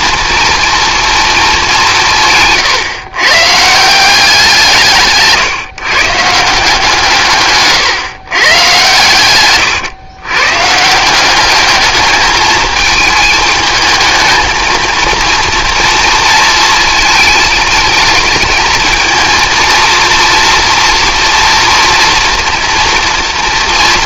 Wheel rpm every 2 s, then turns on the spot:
230, 140, 170, 170, 140, 140, 220, 220, 230, 220, 240, 230.
none